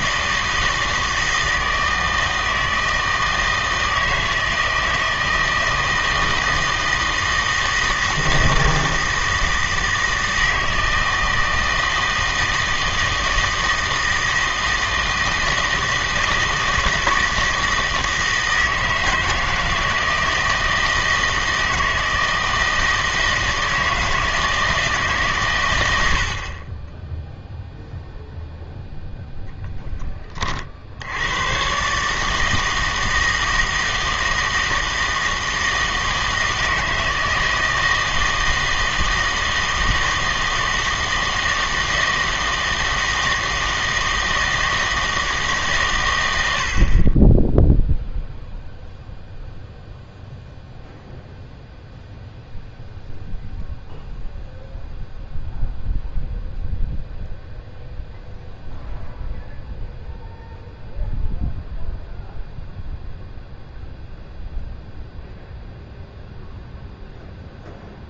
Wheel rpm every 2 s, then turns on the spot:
160, 160, 160, 160, 160, 160, 160, 160, 160, 160, 160, 160, 160, 30, 0, 50, 160, 160, 160, 160, 160, 160, 160, 70, 0, 0, 0, 0, 0, 0, 0, 0, 0, 0.
none